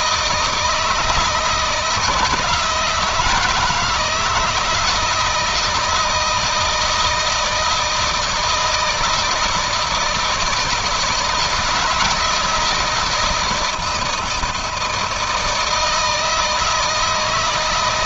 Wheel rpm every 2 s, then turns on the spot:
170, 170, 160, 160, 160, 160, 160, 160, 160.
none